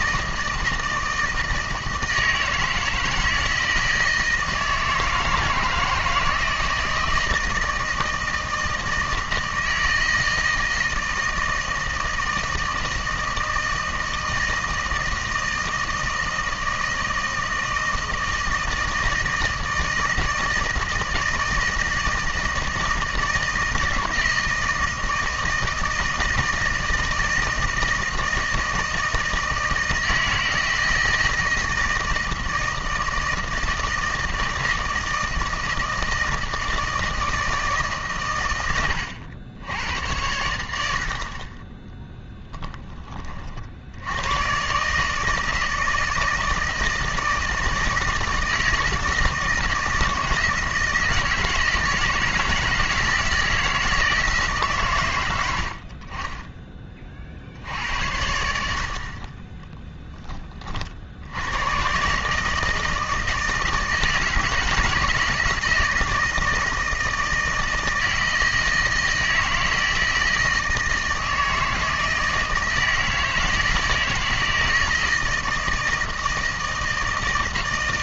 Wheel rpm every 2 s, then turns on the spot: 160, 160, 160, 160, 160, 160, 160, 160, 160, 160, 160, 160, 160, 160, 160, 160, 160, 160, 160, 110, 90, 10, 120, 160, 160, 160, 160, 150, 20, 70, 40, 160, 160, 160, 160, 160, 160, 160, 160.
none